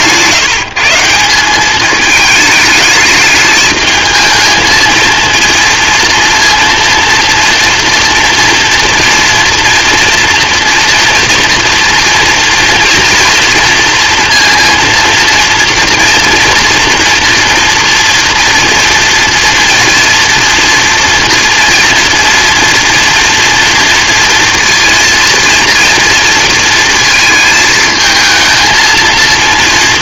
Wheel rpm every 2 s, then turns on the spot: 160, 210, 220, 230, 230, 230, 230, 230, 230, 230, 230, 230, 230, 230, 220.
none